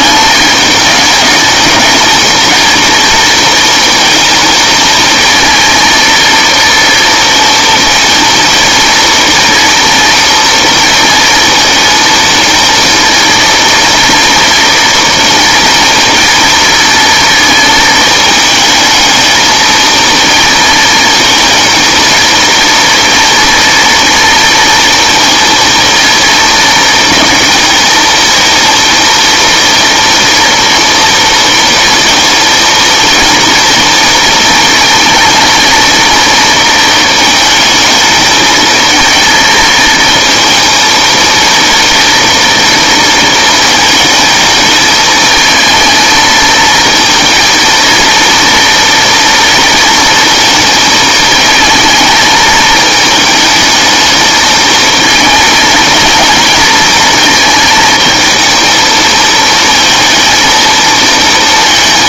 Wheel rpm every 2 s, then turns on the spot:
210, 230, 220, 230, 230, 230, 230, 240, 230, 220, 220, 230, 230, 220, 230, 230, 230, 230, 230, 220, 220, 230, 220, 230, 230, 220, 220, 220, 230, 220, 230.
none